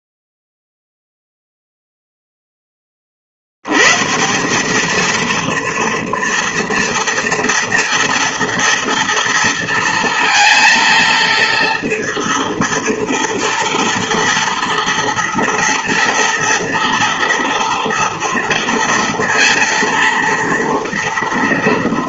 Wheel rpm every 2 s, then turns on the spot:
0, 50, 230, 230, 230, 230, 230, 230, 230, 230, 230.
none